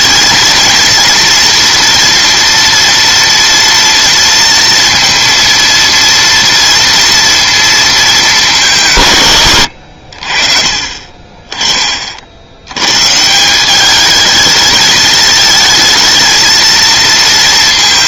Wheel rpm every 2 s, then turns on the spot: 230, 240, 230, 230, 180, 40, 90, 220, 220.
none